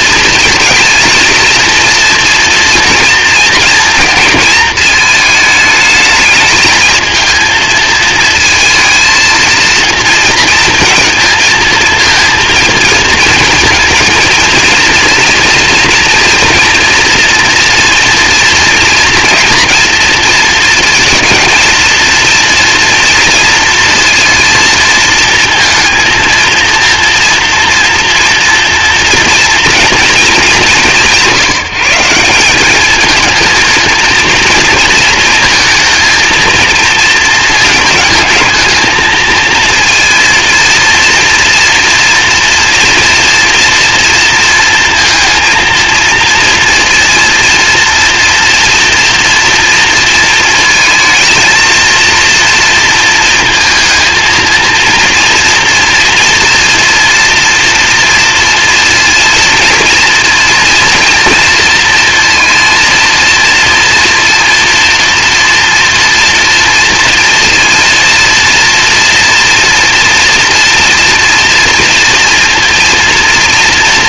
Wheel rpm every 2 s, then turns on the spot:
230, 240, 230, 220, 220, 230, 230, 230, 230, 240, 230, 230, 230, 230, 230, 190, 200, 230, 220, 220, 230, 240, 230, 230, 230, 230, 230, 230, 230, 220, 230, 230, 230, 230, 230, 230, 230.
none